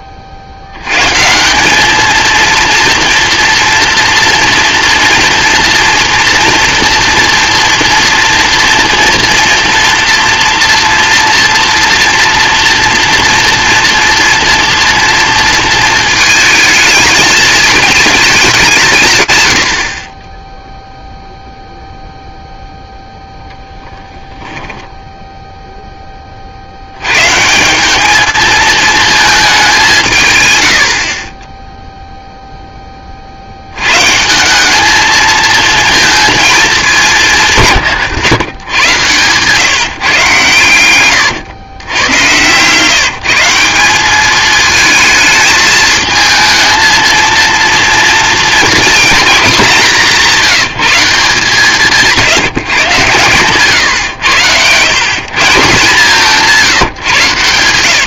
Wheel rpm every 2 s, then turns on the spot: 100, 240, 240, 230, 230, 230, 230, 230, 220, 150, 0, 0, 10, 90, 220, 60, 20, 210, 200, 120, 120, 160, 220, 230, 240, 170, 130, 150, 140.
40-42 52-54